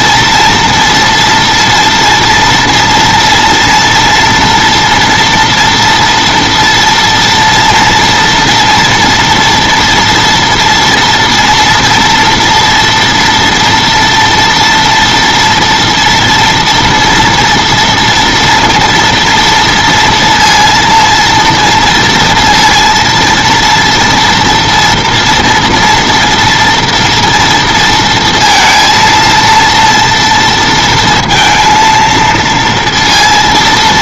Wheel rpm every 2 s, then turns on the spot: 240, 230, 230, 230, 240, 230, 230, 230, 230, 240, 230, 230, 230, 230, 230, 230, 230.
none